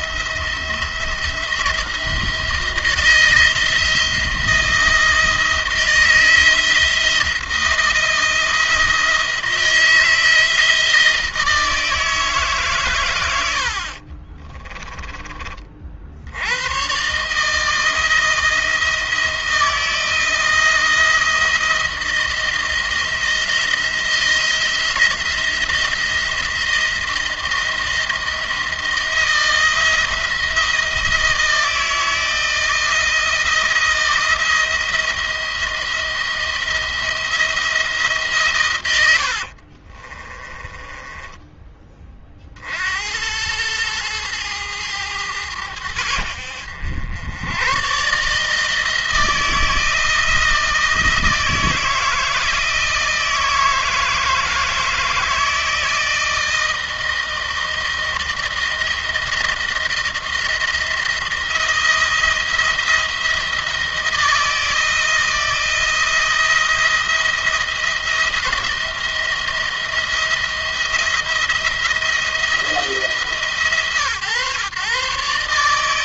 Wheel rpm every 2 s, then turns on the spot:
170, 170, 170, 170, 170, 160, 140, 30, 110, 160, 170, 170, 170, 170, 170, 170, 160, 170, 170, 130, 20, 50, 110, 80, 160, 160, 160, 160, 160, 160, 170, 170, 160, 170, 170, 170, 160, 130.
14-16 40-42